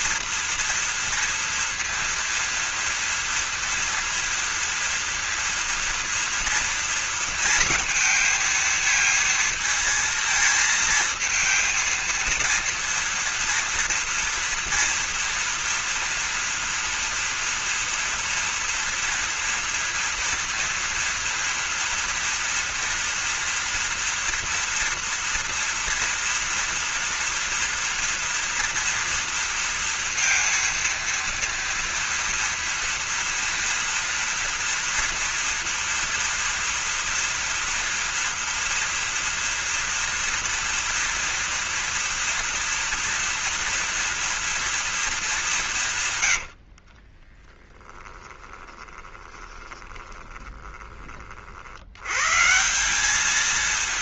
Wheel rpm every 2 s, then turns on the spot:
230, 230, 230, 230, 230, 230, 230, 230, 230, 230, 240, 230, 230, 230, 240, 230, 230, 230, 230, 230, 230, 230, 230, 90, 20, 20, 150.
46-52